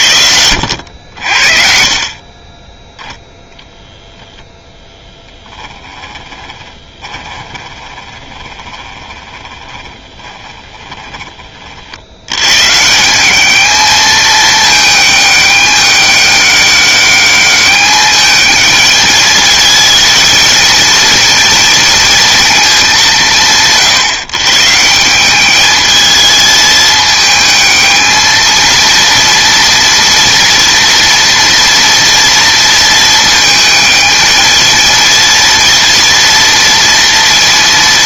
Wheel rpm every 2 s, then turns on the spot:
70, 0, 0, 20, 20, 20, 150, 220, 200, 210, 220, 180, 170, 220, 230, 230, 230, 220, 230.
6-12